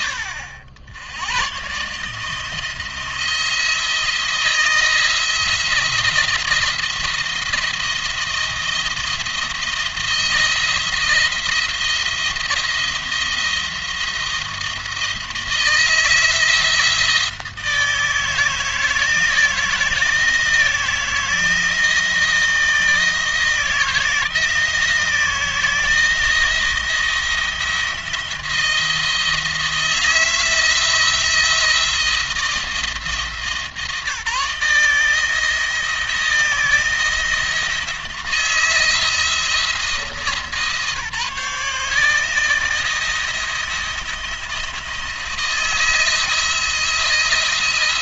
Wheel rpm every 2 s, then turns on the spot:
90, 160, 160, 160, 170, 170, 170, 170, 160, 160, 160, 170, 160, 170, 170, 160, 170, 160, 160, 160, 150, 170, 170, 160.
none